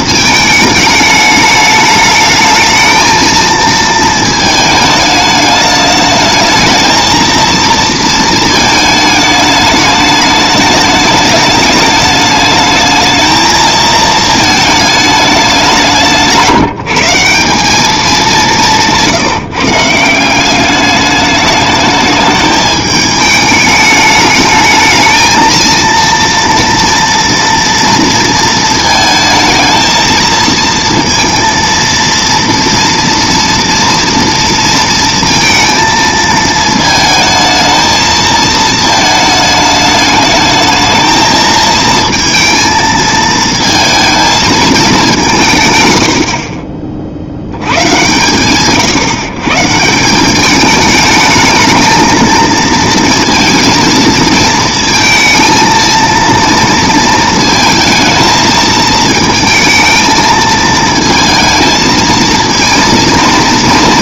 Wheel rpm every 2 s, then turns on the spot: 210, 220, 220, 220, 220, 210, 210, 220, 170, 180, 200, 210, 220, 230, 220, 230, 230, 230, 220, 220, 220, 220, 210, 40, 130, 210, 230, 230, 230, 220, 220, 230.
none